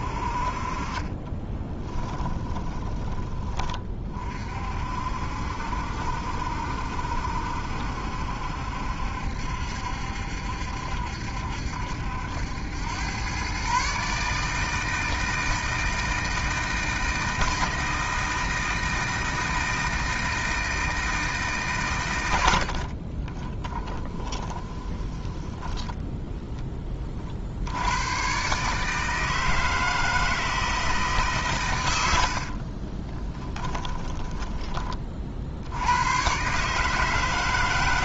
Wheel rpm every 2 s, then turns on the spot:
30, 20, 60, 70, 70, 70, 110, 160, 160, 160, 160, 40, 10, 30, 150, 150, 30, 40, 160.
0-2 22-26 32-34